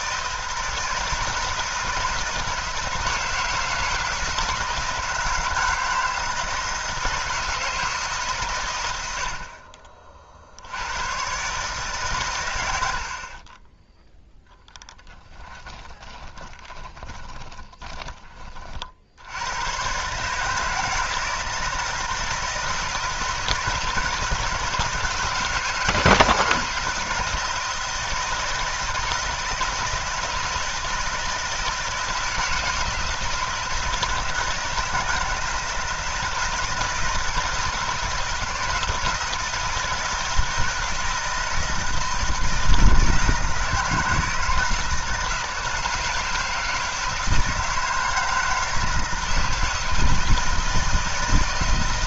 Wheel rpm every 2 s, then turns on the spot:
160, 160, 160, 160, 80, 100, 60, 10, 20, 70, 160, 160, 160, 160, 160, 160, 160, 160, 160, 160, 160, 160, 160, 160, 160, 160.
14-18